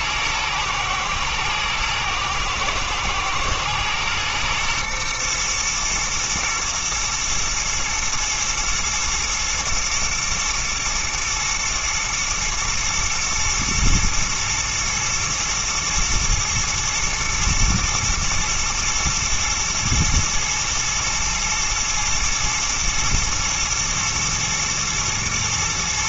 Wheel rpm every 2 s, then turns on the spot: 110, 110, 120, 120, 110, 120, 110, 120, 120, 110, 110, 120, 110.
none